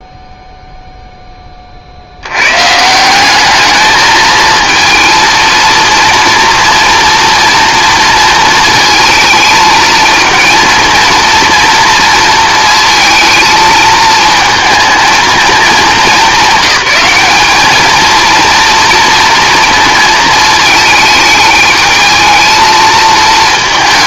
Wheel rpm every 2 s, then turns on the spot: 0, 150, 220, 230, 220, 230, 230, 230, 210, 230, 220, 220.
none